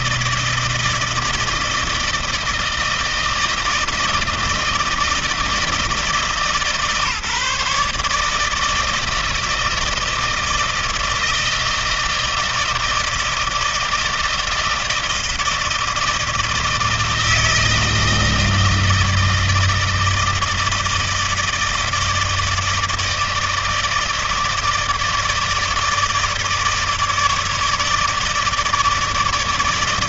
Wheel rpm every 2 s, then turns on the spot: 160, 160, 160, 150, 160, 160, 160, 160, 160, 160, 160, 160, 160, 160, 160.
none